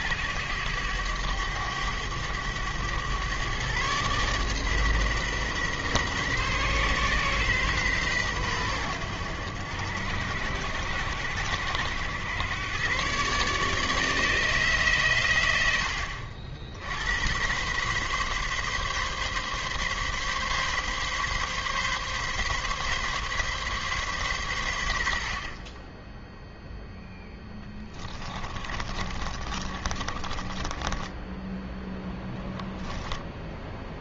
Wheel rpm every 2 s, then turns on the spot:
100, 110, 130, 120, 100, 70, 120, 130, 90, 140, 140, 140, 80, 10, 30, 20, 10.
28-32